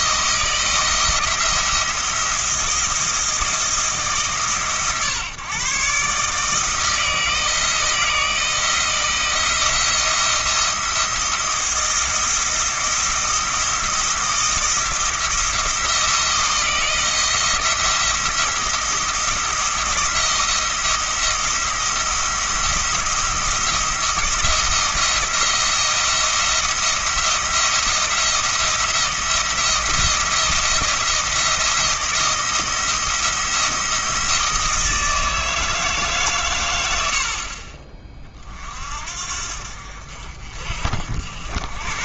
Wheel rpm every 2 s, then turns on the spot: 170, 160, 140, 160, 160, 170, 170, 170, 170, 170, 170, 170, 170, 170, 170, 170, 170, 160, 90, 50, 60.
none